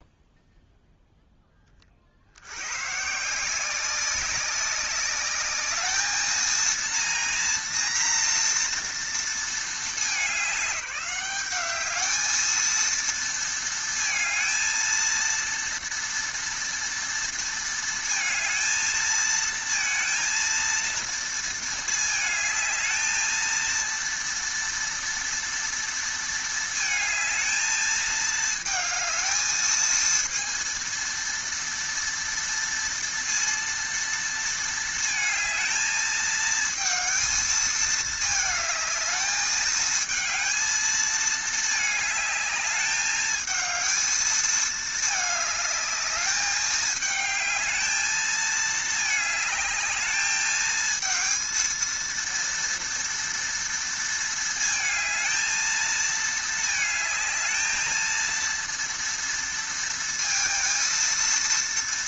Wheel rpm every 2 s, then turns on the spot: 0, 100, 190, 230, 230, 190, 220, 220, 230, 220, 230, 220, 230, 220, 220, 230, 230, 230, 220, 220, 220, 210, 220, 210, 220, 220, 230, 220, 220, 230, 230.
none